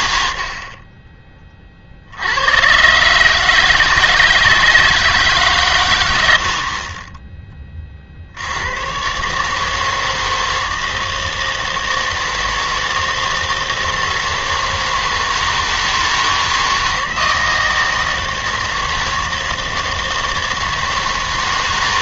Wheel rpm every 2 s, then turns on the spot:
50, 110, 160, 60, 90, 160, 160, 160, 160, 160, 160.
none